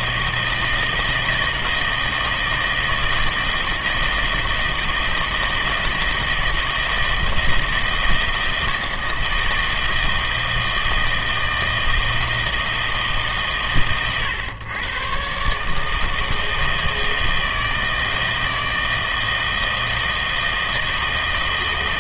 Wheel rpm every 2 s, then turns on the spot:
160, 160, 160, 160, 160, 160, 160, 120, 160, 160, 160.
none